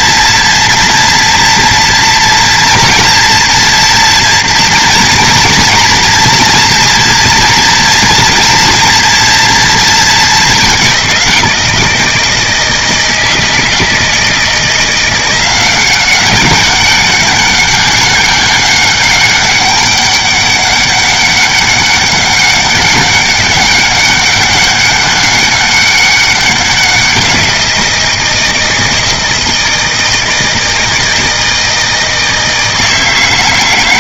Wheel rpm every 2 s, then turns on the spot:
230, 230, 230, 240, 230, 200, 170, 170, 190, 200, 200, 200, 200, 180, 160, 160, 160.
none